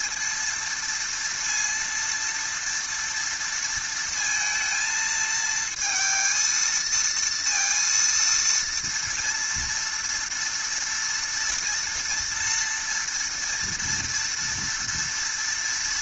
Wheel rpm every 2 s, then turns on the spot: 230, 230, 230, 230, 230, 230, 230, 230.
none